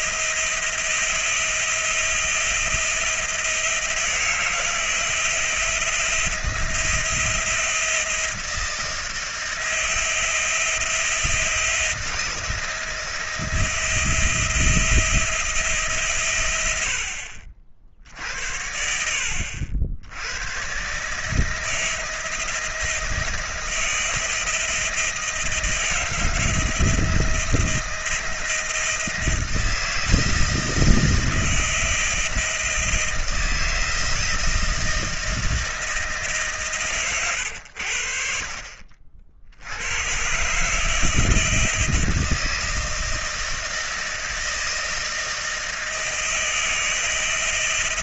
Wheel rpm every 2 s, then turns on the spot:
170, 170, 170, 170, 170, 170, 170, 170, 130, 70, 90, 160, 160, 160, 160, 160, 160, 160, 160, 70, 110, 160, 160, 160.
none